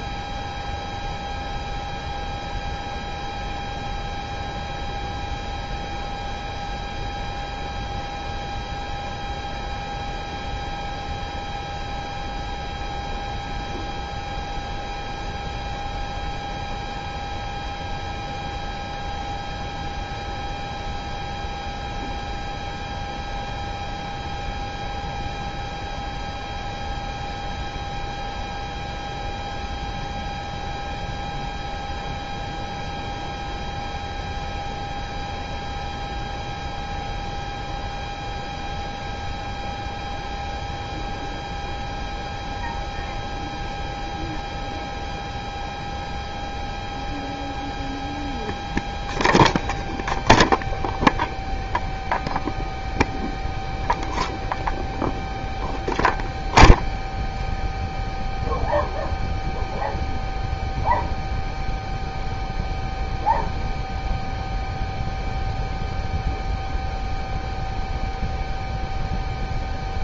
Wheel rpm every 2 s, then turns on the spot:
0, 0, 0, 0, 0, 0, 0, 0, 0, 0, 0, 0, 0, 0, 0, 0, 0, 0, 0, 0, 0, 0, 0, 0, 0, 0, 0, 0, 0, 0, 0, 0, 0, 0, 0.
none